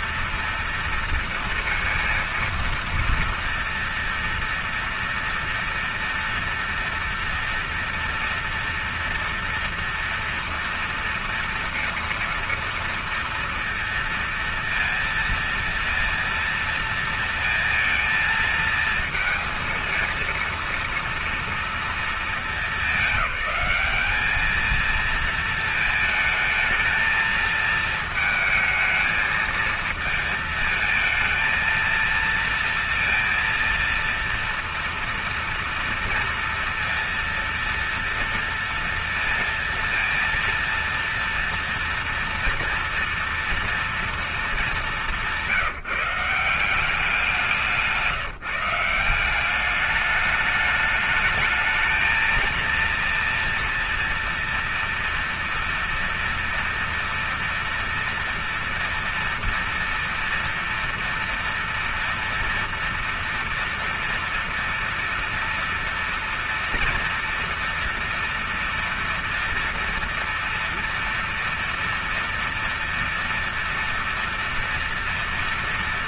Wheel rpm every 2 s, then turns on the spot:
230, 230, 230, 230, 230, 230, 230, 230, 230, 230, 230, 230, 210, 220, 220, 220, 230, 230, 230, 230, 230, 230, 230, 170, 170, 210, 220, 230, 230, 230, 230, 240, 230, 230, 230, 230, 230, 230.
none